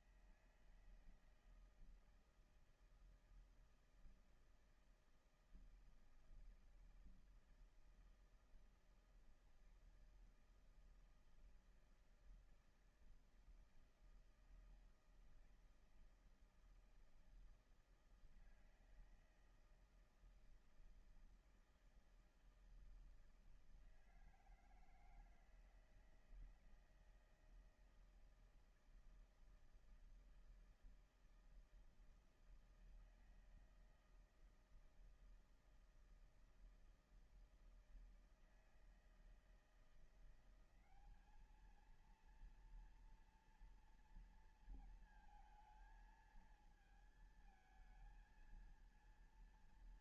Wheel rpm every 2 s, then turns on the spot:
160, 160, 160, 160, 160, 160, 160, 160, 160, 160, 160, 160, 160, 160, 160, 160, 160, 160, 160, 160, 180, 230, 230, 220, 230.
none